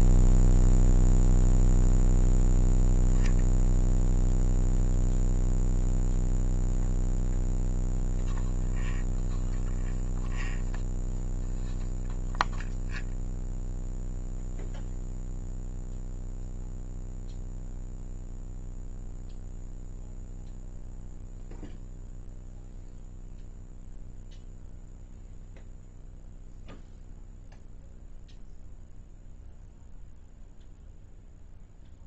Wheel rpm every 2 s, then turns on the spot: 0, 0, 0, 0, 0, 0, 0, 0, 0, 0, 0, 0, 0, 0, 0, 0.
none